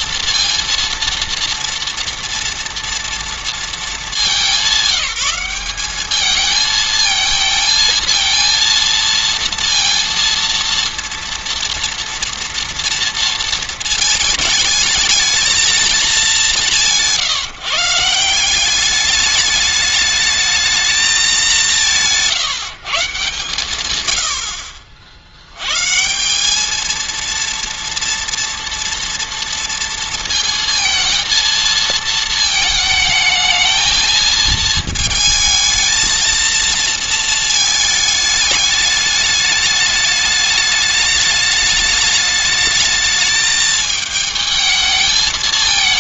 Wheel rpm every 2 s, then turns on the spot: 230, 220, 200, 230, 230, 230, 220, 220, 160, 210, 180, 150, 100, 230, 230, 220, 220, 220, 220, 210, 210, 220, 220.
none